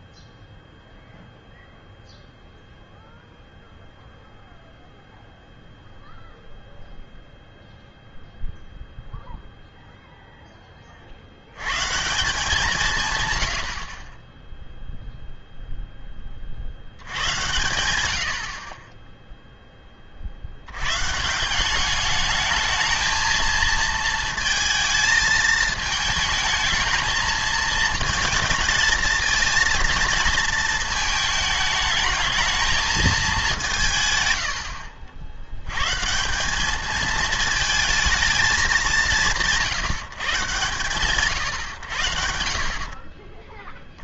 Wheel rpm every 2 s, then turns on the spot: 0, 0, 0, 0, 0, 10, 180, 0, 60, 40, 80, 220, 220, 220, 220, 220, 220, 90, 210, 210, 130, 50.
none